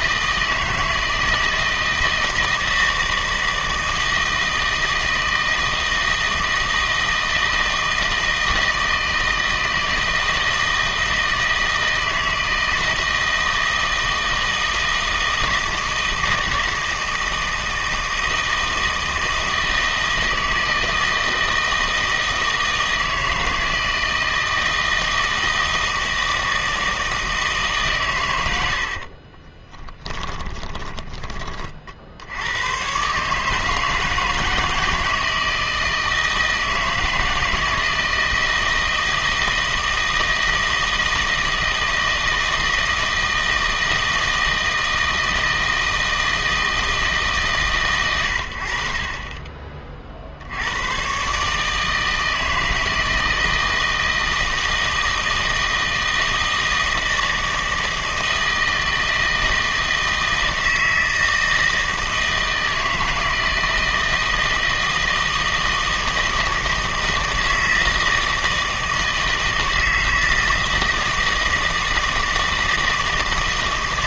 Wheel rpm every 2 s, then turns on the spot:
160, 160, 160, 160, 160, 160, 160, 160, 160, 160, 160, 160, 160, 160, 80, 20, 100, 160, 160, 160, 160, 160, 160, 160, 70, 90, 160, 160, 160, 160, 160, 160, 160, 160, 160, 160, 160.
28-32